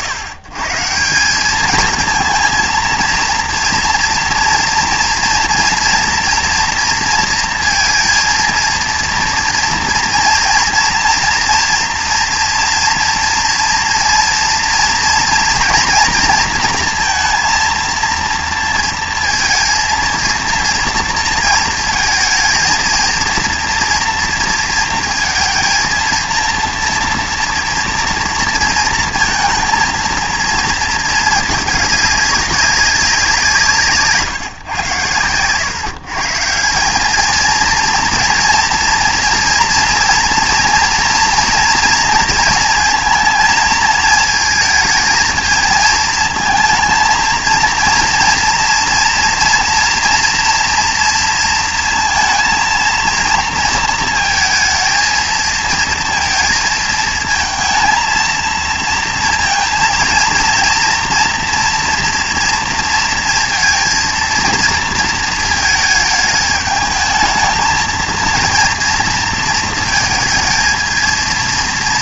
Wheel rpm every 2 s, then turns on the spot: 100, 230, 230, 230, 230, 230, 230, 230, 230, 230, 230, 230, 230, 230, 230, 230, 190, 120, 190, 230, 230, 230, 220, 220, 230, 230, 230, 230, 220, 230, 230, 230, 230, 220, 230, 230.
none